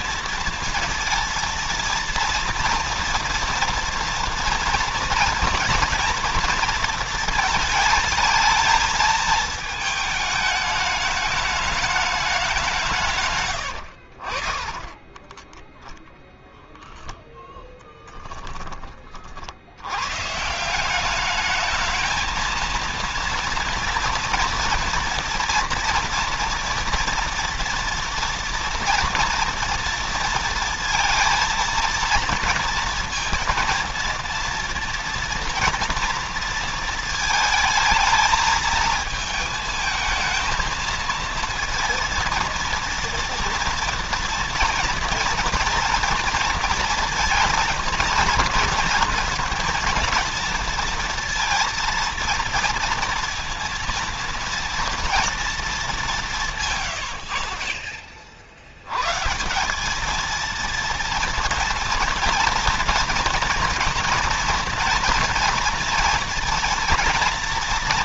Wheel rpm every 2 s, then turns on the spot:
230, 240, 230, 230, 220, 210, 180, 40, 0, 30, 180, 230, 240, 240, 230, 230, 230, 230, 230, 220, 220, 230, 240, 230, 230, 230, 230, 240, 150, 80, 230, 230, 230, 230.
14-16